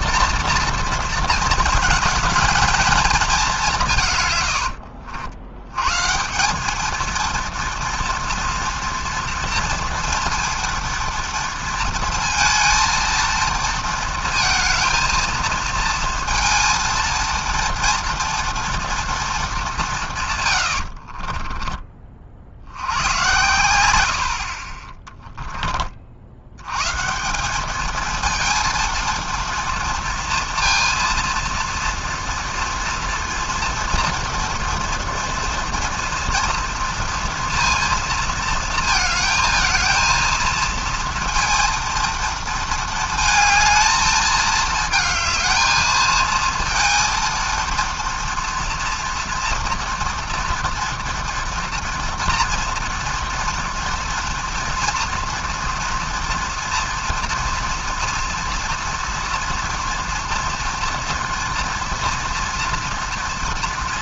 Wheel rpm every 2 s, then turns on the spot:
230, 230, 90, 190, 240, 230, 230, 230, 230, 230, 100, 60, 40, 90, 230, 230, 230, 230, 230, 220, 230, 230, 220, 230, 230, 230, 230, 230, 230, 230, 240, 230.
4-6